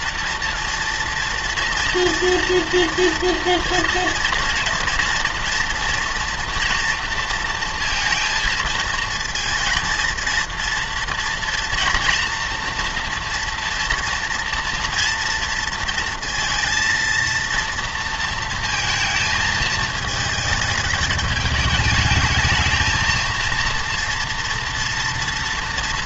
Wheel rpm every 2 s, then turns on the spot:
230, 230, 230, 240, 230, 230, 230, 230, 230, 230, 220, 220, 230.
none